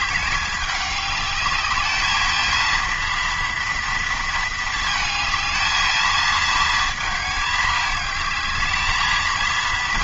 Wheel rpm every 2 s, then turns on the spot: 200, 230, 220, 220, 220.
none